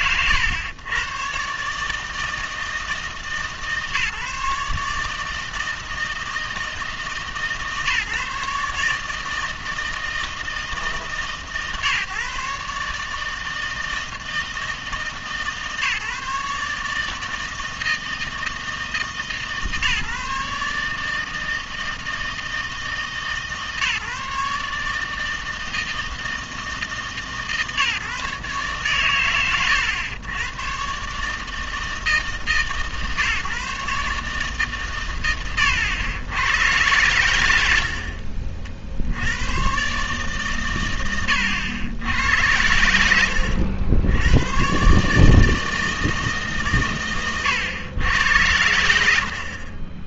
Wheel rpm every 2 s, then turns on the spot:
120, 160, 150, 160, 150, 160, 140, 160, 150, 160, 150, 160, 150, 160, 130, 110, 150, 130, 110, 60, 120, 80, 120, 140, 90.
42-44